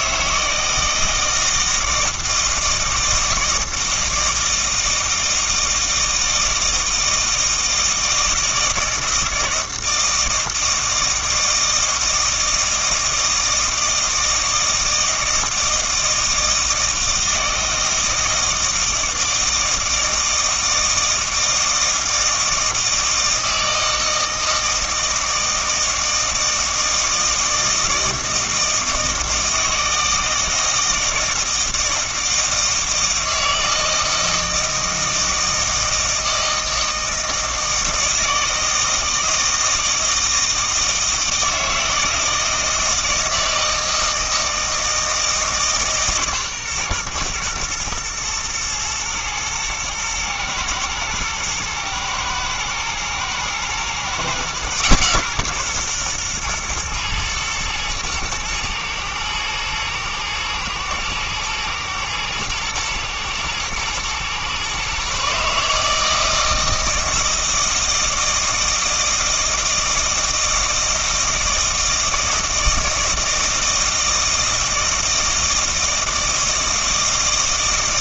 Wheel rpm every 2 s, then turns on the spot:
160, 160, 160, 160, 160, 160, 160, 160, 160, 160, 160, 160, 160, 160, 160, 160, 160, 160, 160, 160, 160, 160, 160, 130, 110, 110, 110, 130, 120, 110, 110, 110, 130, 160, 160, 160, 160, 160, 160.
none